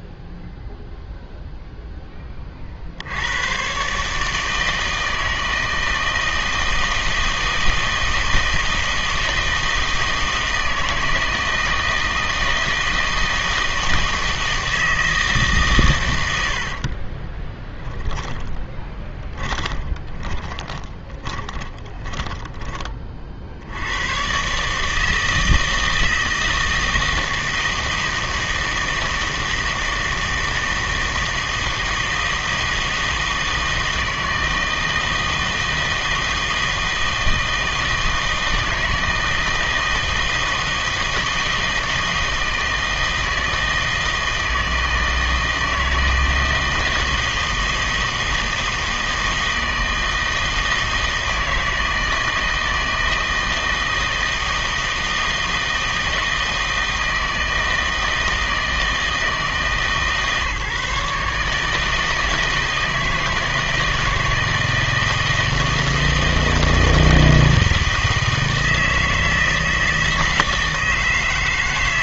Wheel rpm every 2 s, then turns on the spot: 0, 50, 160, 160, 160, 160, 160, 160, 70, 10, 20, 20, 140, 160, 160, 160, 160, 160, 160, 160, 160, 160, 160, 160, 160, 160, 160, 160, 160, 160, 150, 160, 160, 160, 160, 160.
16-22